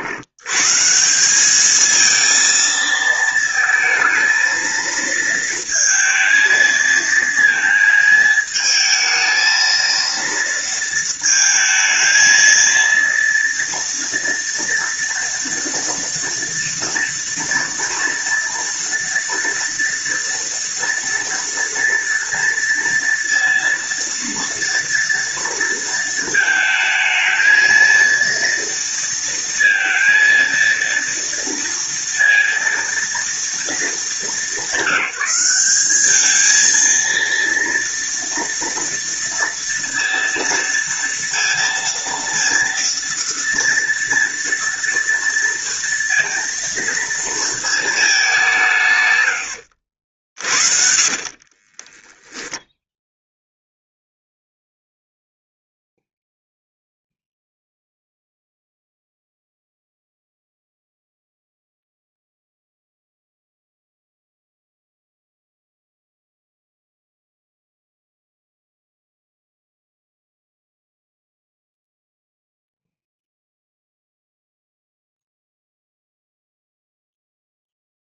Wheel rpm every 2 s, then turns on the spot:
140, 230, 230, 230, 220, 230, 230, 230, 230, 230, 230, 230, 240, 220, 230, 230, 230, 210, 220, 230, 230, 230, 230, 230, 160, 50, 0, 0, 0, 0, 0, 0, 0, 0, 0, 0, 0, 0, 0.
50-52